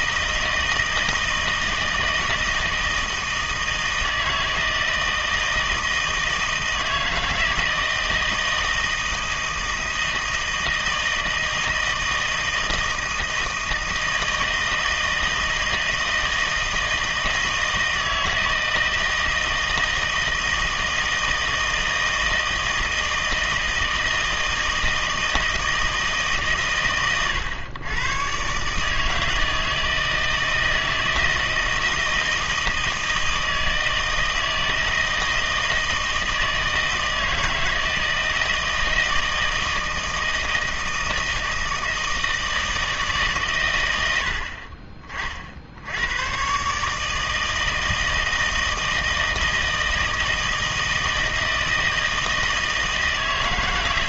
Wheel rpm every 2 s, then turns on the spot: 160, 160, 160, 160, 160, 160, 160, 160, 160, 160, 160, 160, 160, 140, 140, 160, 160, 160, 160, 160, 160, 160, 60, 130, 160, 160, 160.
none